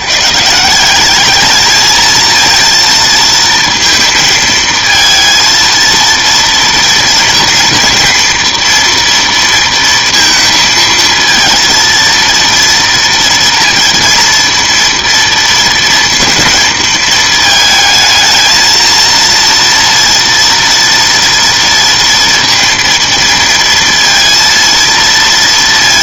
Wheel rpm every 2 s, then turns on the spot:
180, 230, 230, 230, 230, 230, 230, 230, 220, 230, 230, 230, 230.
none